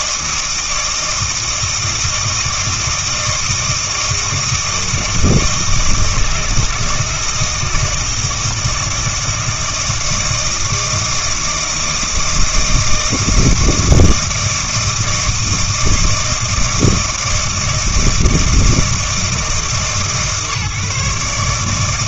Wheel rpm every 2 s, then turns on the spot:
160, 160, 160, 160, 160, 160, 160, 160, 160, 160, 140.
none